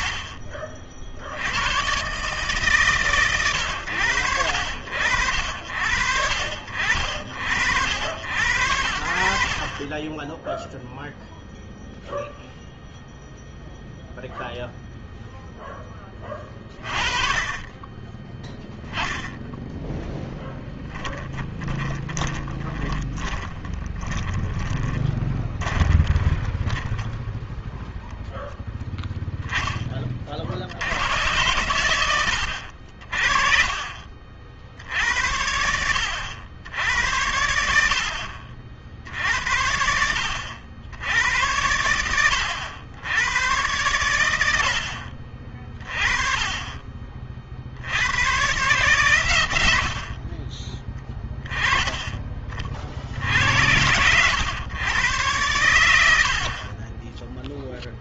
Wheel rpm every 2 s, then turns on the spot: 40, 130, 80, 60, 70, 0, 0, 0, 20, 0, 10, 20, 20, 10, 10, 90, 60, 60, 80, 60, 80, 90, 70, 20, 120, 20, 40, 110, 40.
20-28 56-58